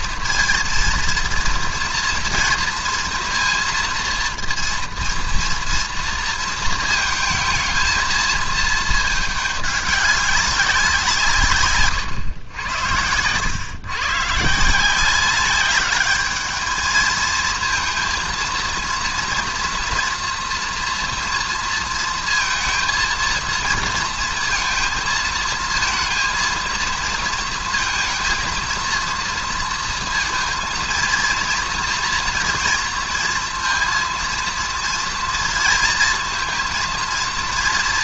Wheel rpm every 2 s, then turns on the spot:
230, 230, 230, 220, 220, 200, 110, 160, 220, 230, 230, 220, 230, 230, 220, 230, 230, 230, 220.
none